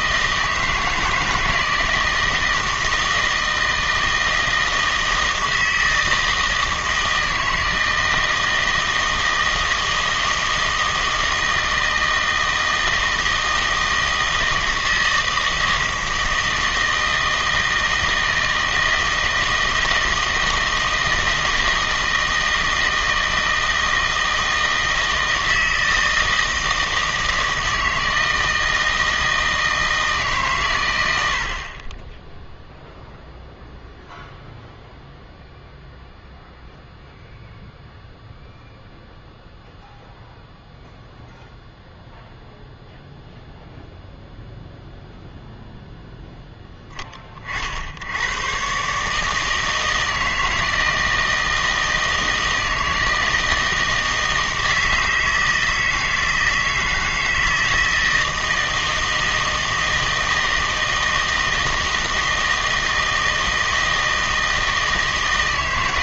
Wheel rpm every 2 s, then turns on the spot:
160, 160, 160, 160, 160, 160, 160, 160, 160, 160, 160, 160, 160, 160, 160, 110, 0, 0, 0, 0, 0, 0, 0, 20, 130, 160, 160, 160, 160, 160, 160, 160, 160.
none